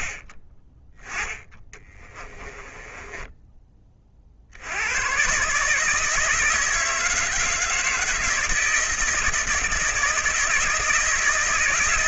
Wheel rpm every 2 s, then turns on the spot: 20, 10, 110, 160, 160, 160.
2-4